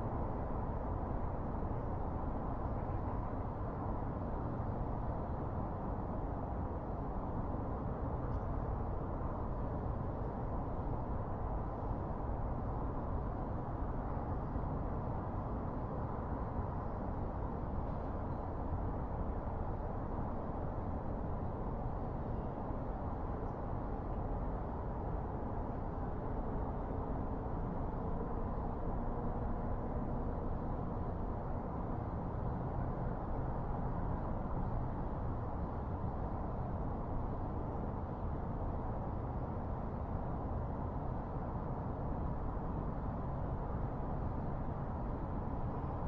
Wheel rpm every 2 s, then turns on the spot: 0, 0, 0, 0, 0, 0, 0, 0, 0, 0, 0, 0, 0, 0, 0, 0, 0, 0, 0, 0, 0, 0, 0.
none